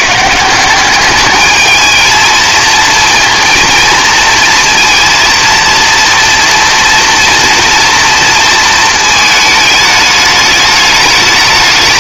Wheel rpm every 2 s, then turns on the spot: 180, 220, 230, 230, 230, 210.
none